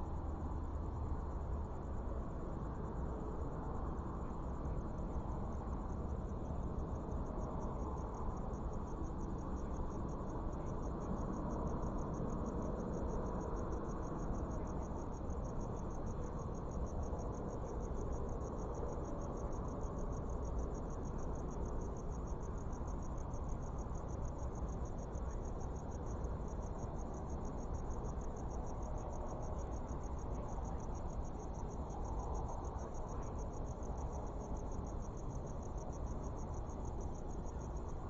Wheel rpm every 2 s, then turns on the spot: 0, 0, 0, 0, 0, 0, 0, 0, 0, 0, 0, 0, 0, 0, 0, 0, 0, 0, 0.
none